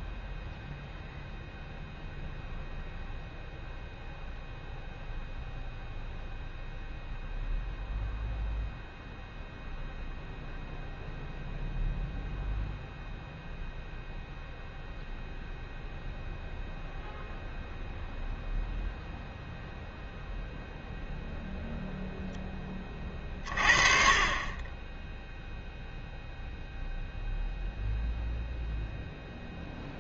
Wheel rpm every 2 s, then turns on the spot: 0, 0, 0, 0, 0, 0, 0, 0, 0, 0, 0, 20, 10, 0, 0.
none